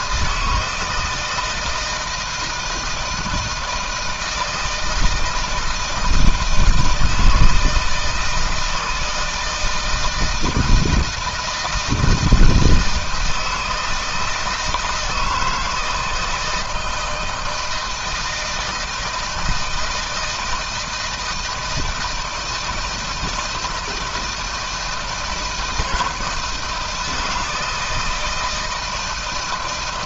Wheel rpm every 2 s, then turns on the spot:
160, 160, 170, 160, 160, 160, 160, 160, 160, 160, 160, 160, 160, 170, 160.
none